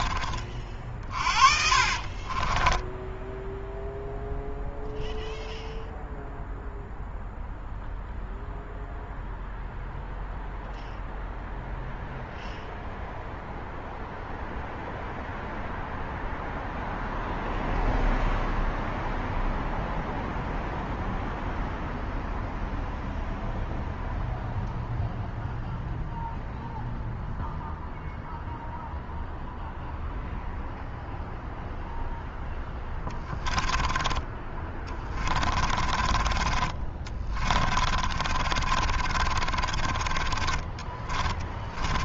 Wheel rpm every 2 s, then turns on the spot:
60, 0, 0, 0, 0, 0, 0, 0, 0, 0, 0, 0, 0, 0, 0, 0, 20, 30, 30, 40, 30.
0-2 32-42